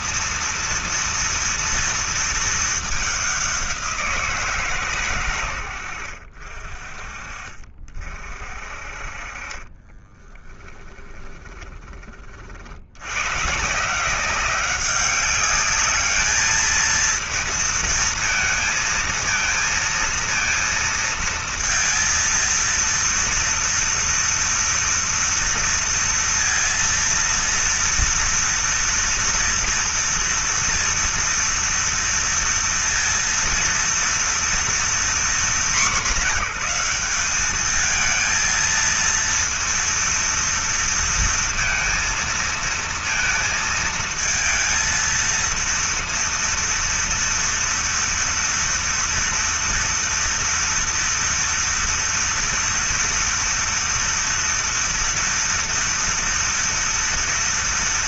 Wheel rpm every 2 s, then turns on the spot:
230, 220, 150, 50, 40, 20, 60, 190, 220, 220, 230, 230, 230, 230, 230, 230, 230, 230, 210, 230, 230, 230, 230, 230, 230, 230, 230, 230, 230.
10-12